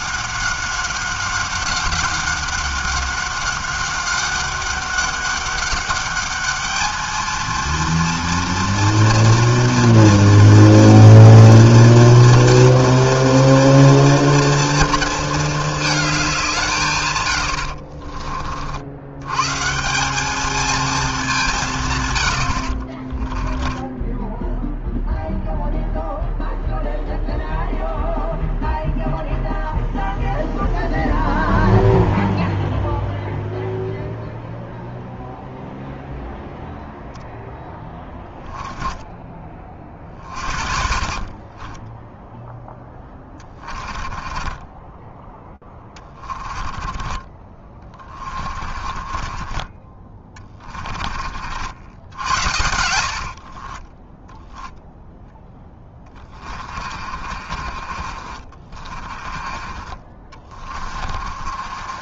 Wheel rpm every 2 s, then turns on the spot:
200, 190, 190, 210, 230, 230, 240, 230, 170, 50, 220, 70, 10, 0, 0, 0, 0, 0, 0, 10, 50, 10, 20, 20, 30, 20, 80, 0, 30, 40, 30.
38-42 44-54 56-62